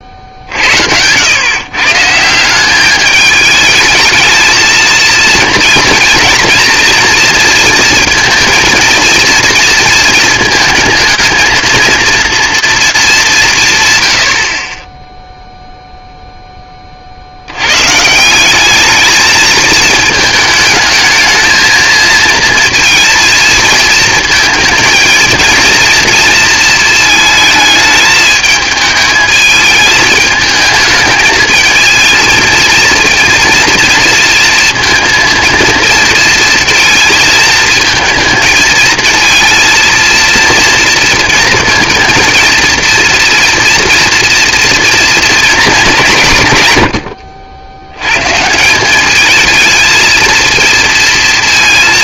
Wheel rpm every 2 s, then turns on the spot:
70, 190, 220, 230, 230, 230, 230, 40, 20, 210, 220, 230, 230, 230, 220, 220, 230, 230, 230, 220, 230, 230, 230, 110, 180, 230.
none